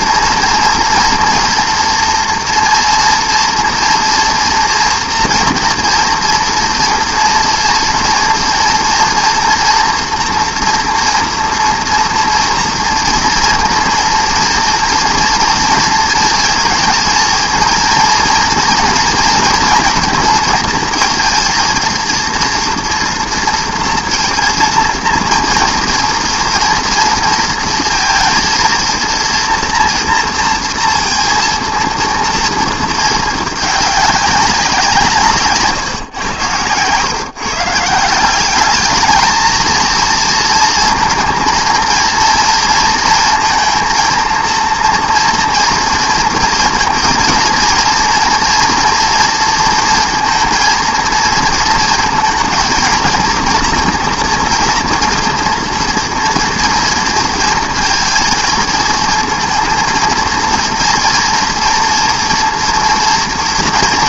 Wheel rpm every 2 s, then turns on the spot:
240, 230, 230, 230, 230, 230, 230, 230, 230, 230, 230, 230, 230, 230, 230, 230, 220, 150, 130, 220, 230, 230, 230, 220, 230, 230, 230, 240, 230, 230, 230, 240.
none